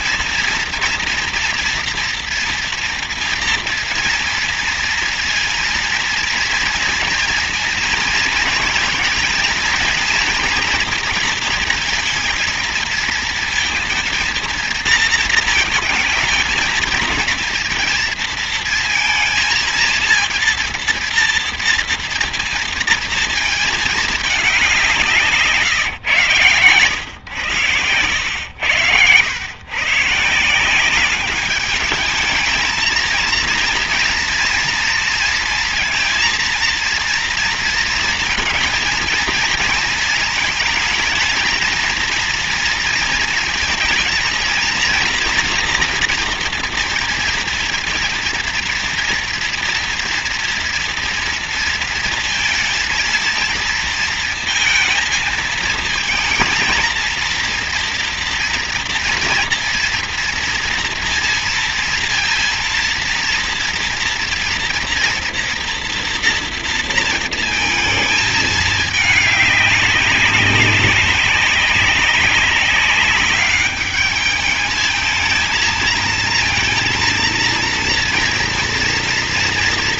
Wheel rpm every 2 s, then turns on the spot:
230, 240, 230, 230, 230, 230, 230, 230, 220, 230, 230, 230, 170, 110, 100, 190, 230, 230, 230, 230, 230, 230, 230, 230, 230, 230, 230, 230, 230, 230, 230, 230, 240, 230, 210, 200, 200, 220, 230, 230.
none